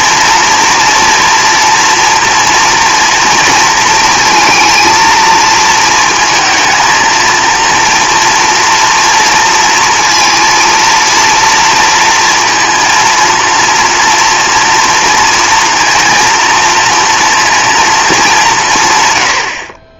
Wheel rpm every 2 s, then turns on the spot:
230, 230, 230, 230, 230, 230, 230, 230, 230, 160.
none